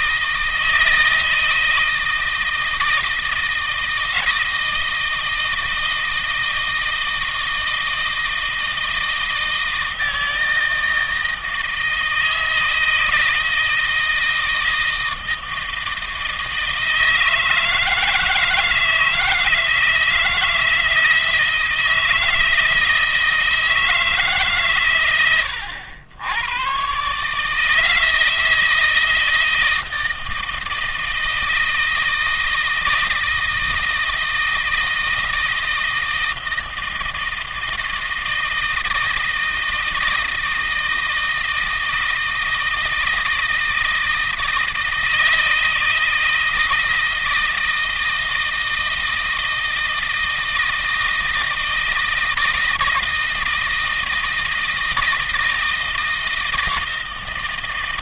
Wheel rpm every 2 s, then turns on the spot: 160, 160, 160, 160, 160, 160, 160, 160, 160, 160, 160, 160, 120, 130, 160, 160, 160, 160, 160, 160, 160, 160, 160, 160, 160, 160, 160, 160, 160.
none